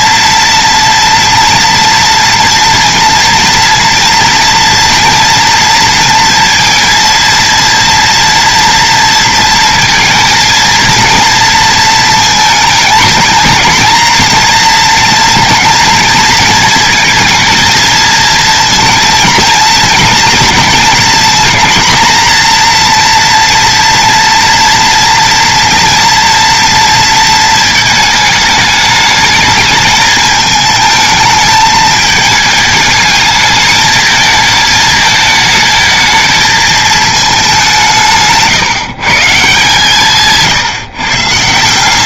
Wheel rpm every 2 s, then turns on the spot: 230, 230, 230, 230, 230, 230, 220, 230, 220, 230, 220, 230, 230, 230, 210, 220, 220, 220, 220, 140, 160.
none